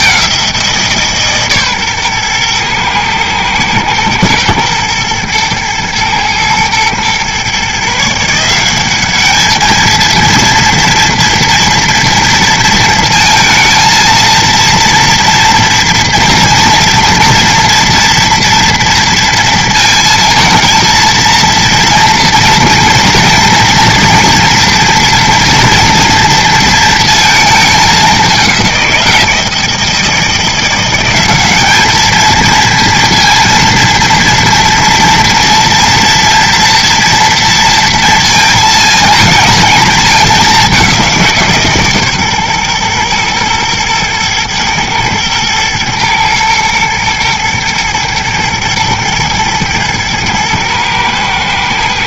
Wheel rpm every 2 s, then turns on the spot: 170, 120, 110, 120, 180, 230, 230, 230, 240, 230, 230, 230, 230, 230, 180, 170, 230, 230, 230, 230, 200, 130, 110, 110, 120, 110.
none